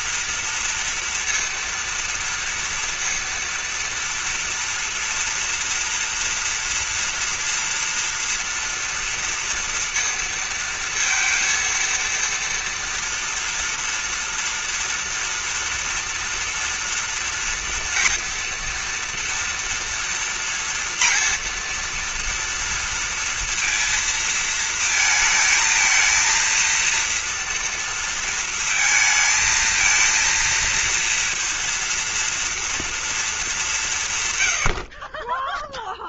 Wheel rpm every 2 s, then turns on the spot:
230, 230, 240, 230, 230, 230, 230, 230, 230, 230, 230, 230, 230, 230, 230, 230, 230, 100.
none